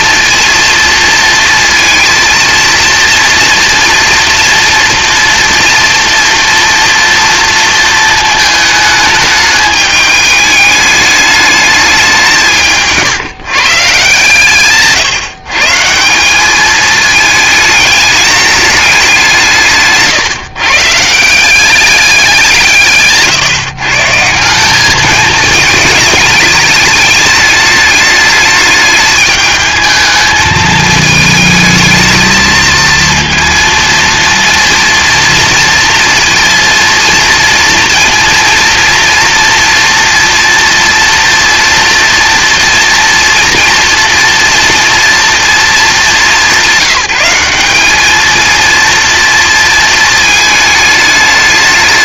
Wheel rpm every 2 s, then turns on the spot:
230, 230, 230, 230, 220, 210, 170, 140, 210, 210, 150, 150, 190, 210, 210, 220, 220, 230, 230, 230, 230, 230, 240, 200, 230, 210.
none